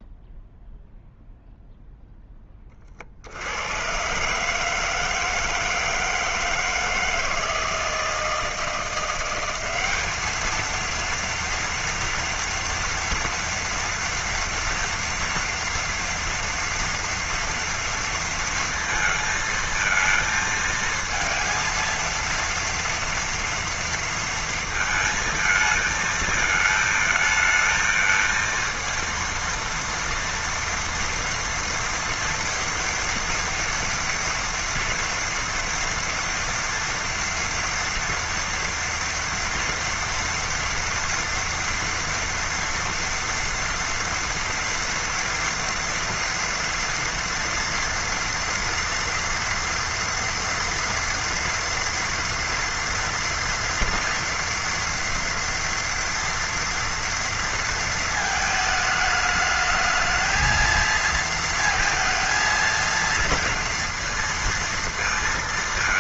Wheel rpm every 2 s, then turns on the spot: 0, 20, 150, 160, 160, 220, 230, 230, 230, 230, 230, 230, 220, 220, 230, 230, 230, 230, 230, 230, 230, 230, 230, 230, 230, 230, 230, 240, 230, 220, 230, 230, 230.
none